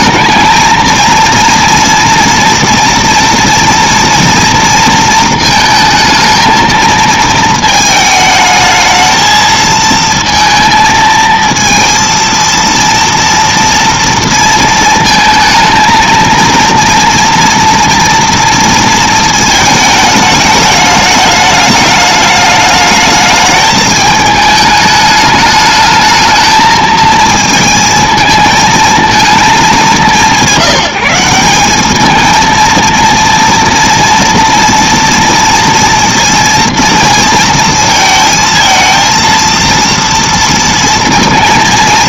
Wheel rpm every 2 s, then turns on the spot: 230, 230, 220, 220, 220, 230, 230, 230, 240, 220, 210, 210, 210, 220, 200, 200, 230, 230, 230, 230, 230.
none